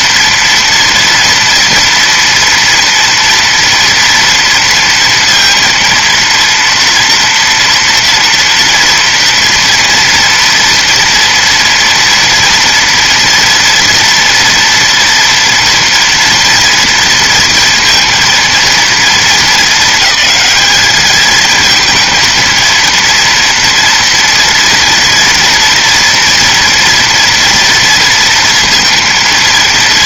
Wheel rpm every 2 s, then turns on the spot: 230, 240, 230, 230, 230, 230, 240, 230, 230, 220, 210, 230, 240, 240, 230.
none